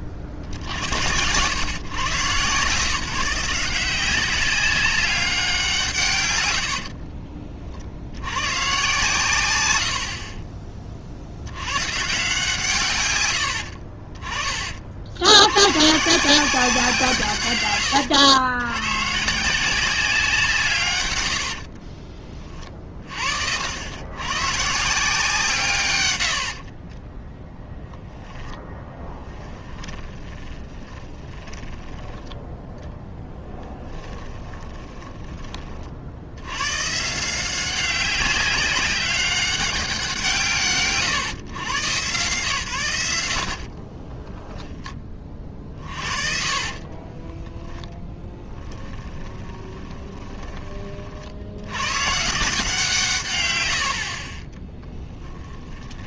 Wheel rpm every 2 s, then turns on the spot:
40, 140, 190, 90, 120, 30, 150, 40, 170, 100, 140, 30, 150, 50, 10, 20, 10, 10, 110, 190, 150, 120, 10, 40, 10, 30, 160, 20.
6-8 26-32 34-36 44-50 54-56